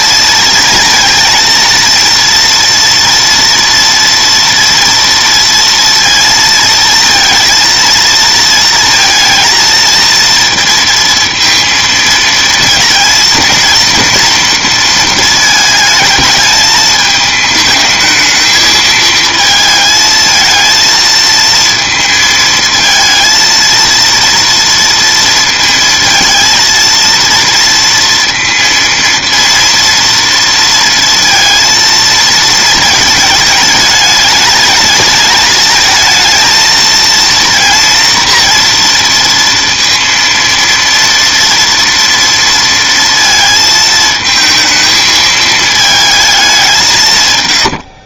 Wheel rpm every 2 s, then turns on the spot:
230, 230, 230, 230, 230, 230, 230, 230, 220, 220, 220, 230, 230, 230, 230, 230, 220, 220, 230, 230, 230, 230, 220, 180.
none